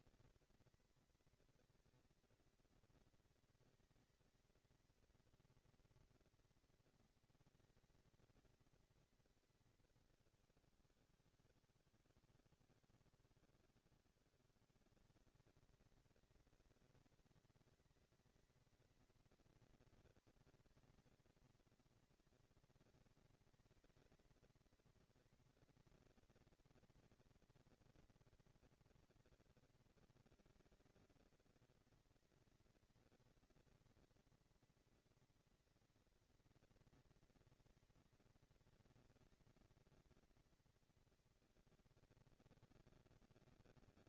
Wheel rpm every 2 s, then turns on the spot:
230, 230, 230, 230, 230, 200, 160, 180, 230, 230, 230, 230, 230, 230, 230, 230, 230, 240, 240, 230, 240, 240.
none